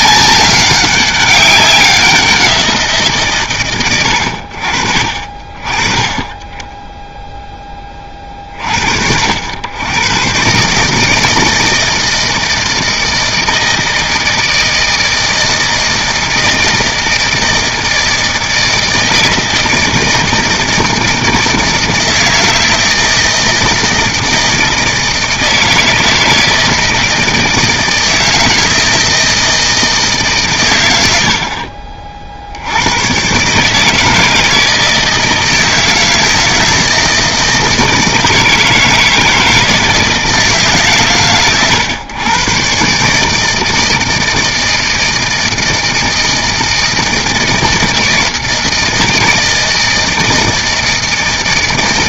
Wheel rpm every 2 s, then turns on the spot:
190, 170, 50, 20, 60, 150, 160, 160, 160, 160, 160, 160, 160, 160, 160, 100, 90, 160, 160, 160, 140, 140, 160, 160, 160, 160.
none